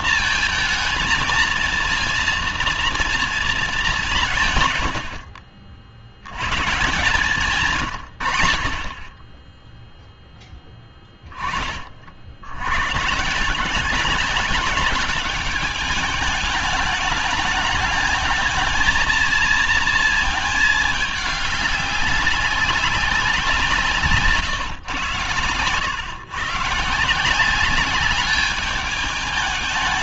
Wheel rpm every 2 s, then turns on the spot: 220, 230, 80, 150, 20, 20, 160, 210, 210, 230, 210, 170, 110, 160, 210.
none